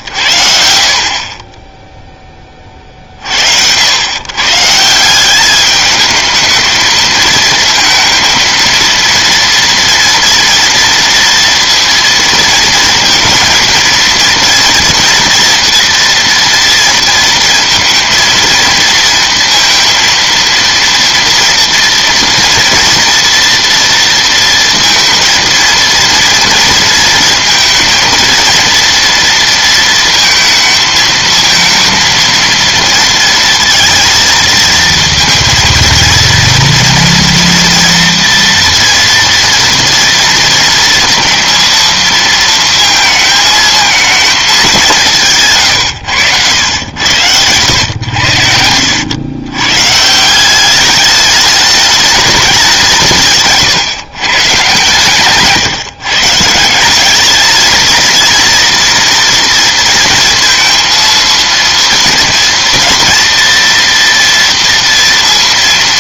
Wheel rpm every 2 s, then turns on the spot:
70, 30, 140, 220, 230, 240, 230, 230, 230, 230, 230, 230, 230, 230, 230, 230, 230, 230, 230, 230, 230, 230, 200, 90, 80, 190, 200, 140, 170, 240, 230, 230, 230.
48-50